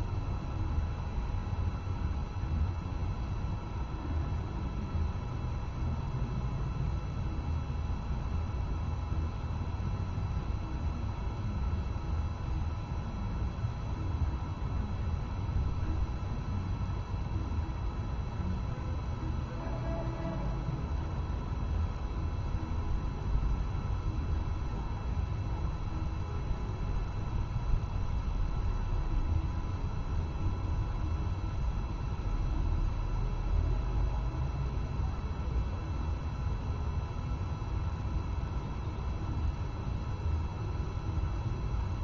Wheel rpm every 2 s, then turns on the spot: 0, 0, 0, 0, 0, 0, 0, 0, 0, 0, 0, 0, 0, 0, 0, 0, 0, 0, 0, 0, 0.
none